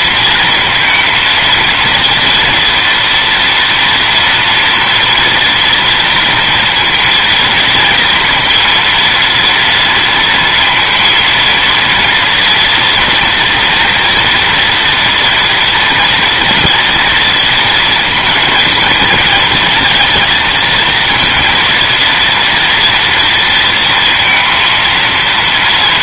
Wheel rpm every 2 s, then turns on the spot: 230, 240, 230, 230, 230, 230, 230, 230, 230, 220, 230, 230, 230.
none